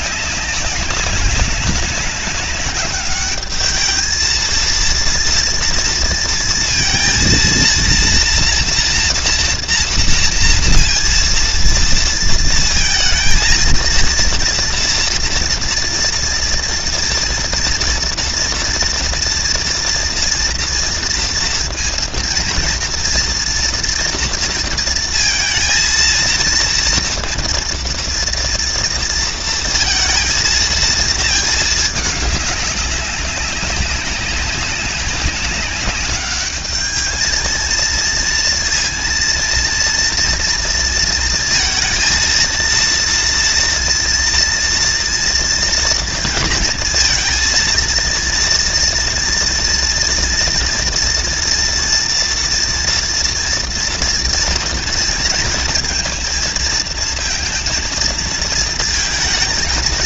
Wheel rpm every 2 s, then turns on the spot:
200, 200, 230, 230, 230, 230, 230, 230, 230, 230, 230, 230, 230, 230, 230, 230, 200, 200, 210, 230, 230, 230, 230, 230, 230, 230, 230, 230, 230, 230.
none